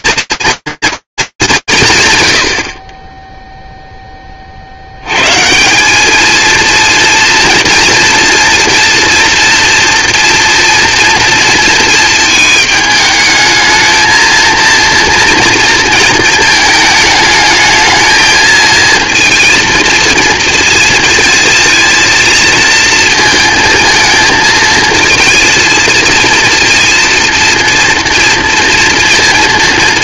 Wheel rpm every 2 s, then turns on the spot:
230, 90, 40, 230, 240, 240, 220, 230, 220, 220, 230, 230, 230, 230, 230.
none